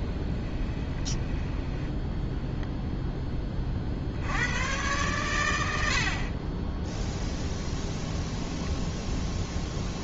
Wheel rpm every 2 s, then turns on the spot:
20, 0, 90, 0, 0.
0-2